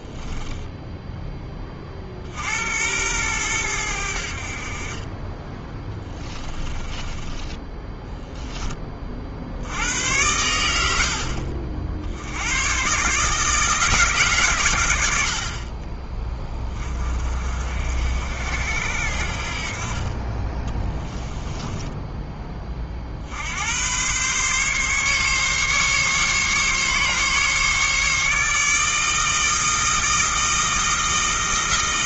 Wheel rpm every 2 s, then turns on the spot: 10, 90, 50, 20, 20, 80, 120, 100, 30, 70, 20, 30, 140, 140, 150, 160.
0-2 6-8 20-22